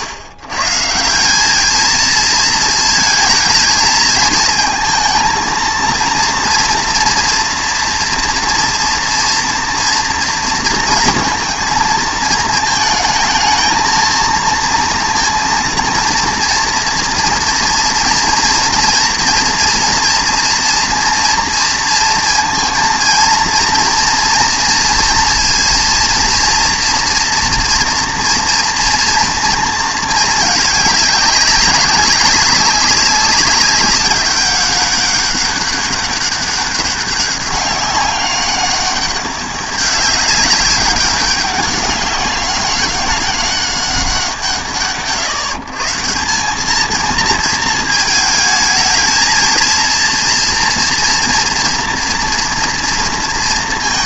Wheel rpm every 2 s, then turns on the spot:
130, 220, 220, 230, 230, 230, 220, 230, 230, 230, 240, 230, 230, 240, 240, 210, 190, 200, 200, 200, 200, 190, 140, 220, 220, 230, 230.
none